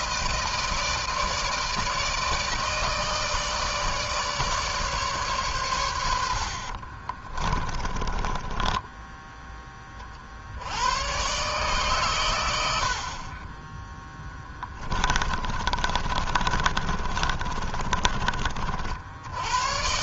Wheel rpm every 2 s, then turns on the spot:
160, 150, 150, 50, 10, 90, 70, 10, 30, 60.
6-10 14-18